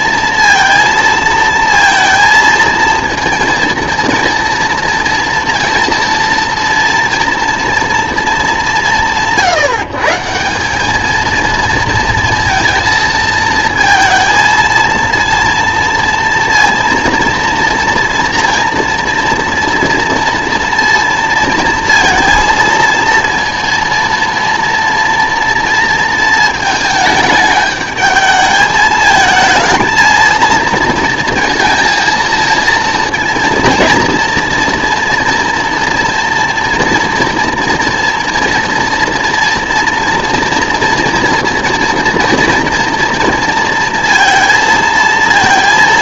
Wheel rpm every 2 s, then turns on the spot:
230, 230, 230, 230, 200, 190, 230, 230, 230, 230, 230, 230, 230, 220, 220, 230, 220, 230, 230, 230, 230, 230, 230.
none